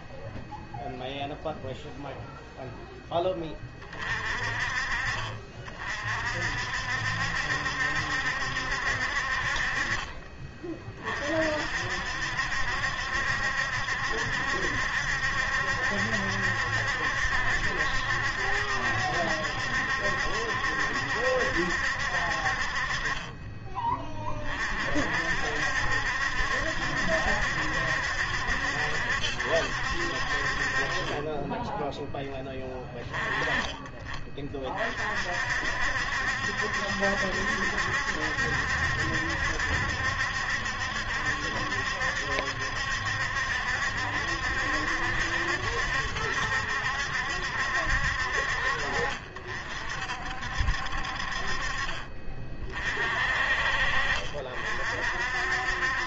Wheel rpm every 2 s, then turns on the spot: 0, 10, 40, 60, 60, 40, 70, 70, 70, 70, 70, 40, 50, 70, 70, 40, 20, 40, 70, 70, 70, 70, 70, 70, 50, 60, 40, 50.
none